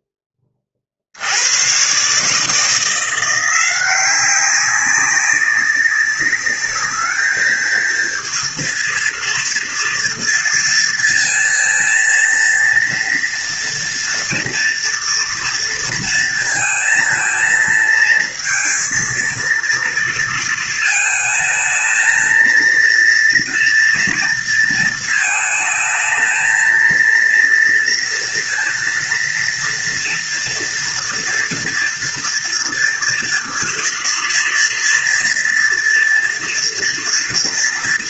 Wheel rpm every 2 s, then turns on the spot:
60, 170, 190, 210, 230, 230, 230, 230, 220, 230, 220, 230, 230, 230, 230, 230, 230, 230, 240.
none